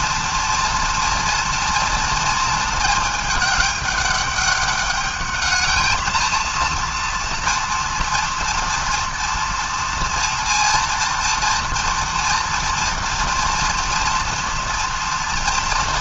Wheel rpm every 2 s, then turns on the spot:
230, 220, 210, 230, 230, 230, 240, 230.
none